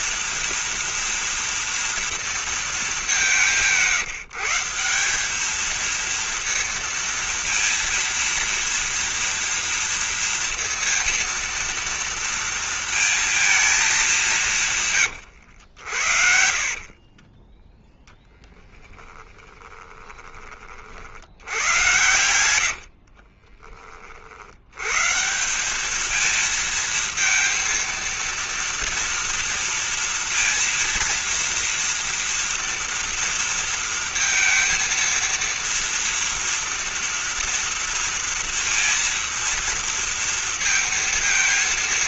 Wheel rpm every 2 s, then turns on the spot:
230, 210, 180, 230, 230, 230, 230, 140, 50, 10, 50, 60, 120, 230, 230, 230, 230, 230, 230, 230, 230.
14-20 22-24